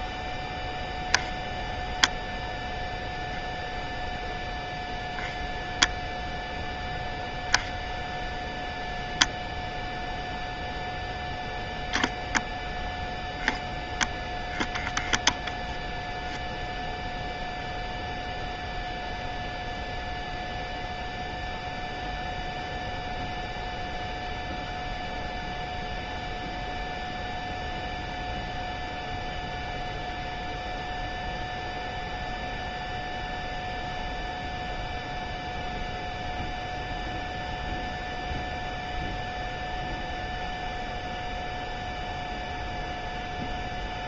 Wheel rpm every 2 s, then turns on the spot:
0, 0, 0, 0, 0, 0, 0, 0, 0, 0, 0, 0, 0, 0, 0, 0, 0, 0, 0, 0, 0, 0.
none